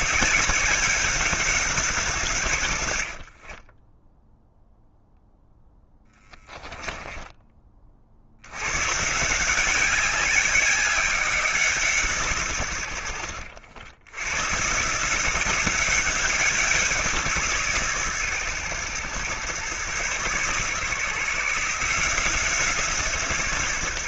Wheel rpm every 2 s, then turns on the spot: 190, 80, 0, 20, 120, 190, 90, 140, 170, 120, 140, 160.
2-4 6-8